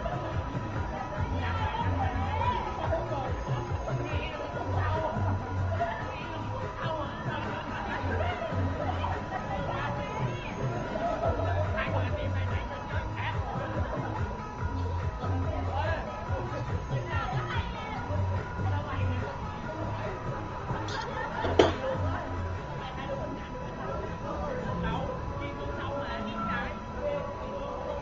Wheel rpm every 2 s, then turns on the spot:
0, 0, 0, 0, 0, 0, 0, 0, 0, 0, 0, 0, 0, 0.
none